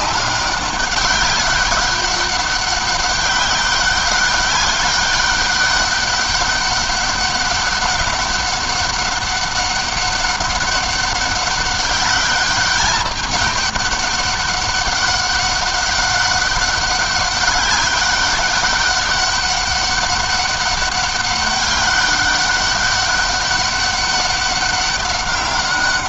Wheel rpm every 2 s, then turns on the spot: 200, 200, 200, 200, 200, 200, 210, 200, 200, 200, 200, 200, 200.
none